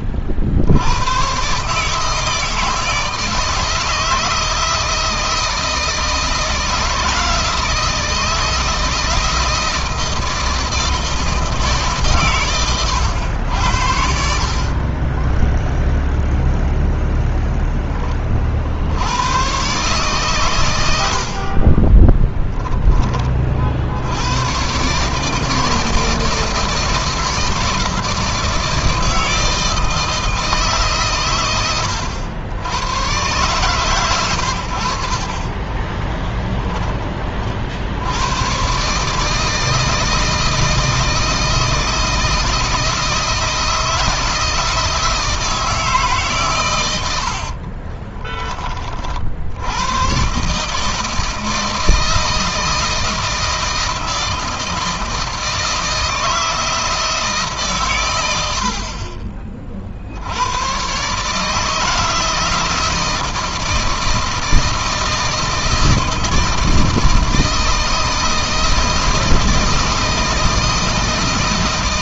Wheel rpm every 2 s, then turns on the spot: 100, 160, 160, 170, 160, 160, 100, 30, 0, 80, 80, 20, 140, 160, 160, 140, 110, 60, 20, 140, 160, 160, 160, 100, 40, 150, 160, 160, 160, 50, 130, 160, 160, 160, 160, 160.
14-16 46-48